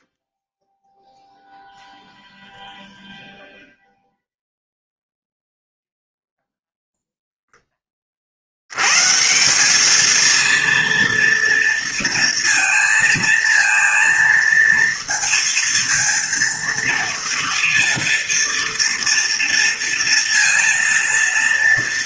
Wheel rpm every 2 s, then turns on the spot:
0, 0, 0, 0, 150, 230, 230, 230, 230, 230, 230.
none